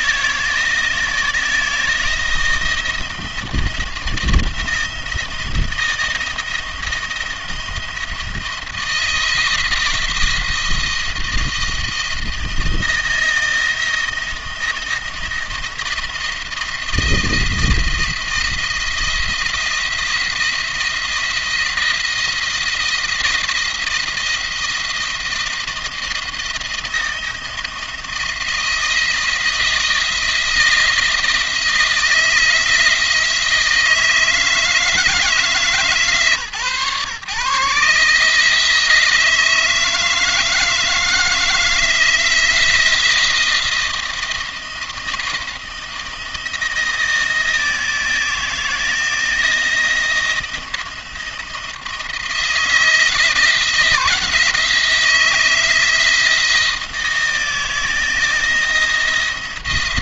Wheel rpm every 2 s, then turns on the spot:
160, 170, 170, 170, 170, 170, 160, 160, 170, 170, 170, 160, 170, 170, 170, 170, 160, 160, 140, 160, 160, 170, 170, 160, 160, 170, 170, 170, 170, 170.
none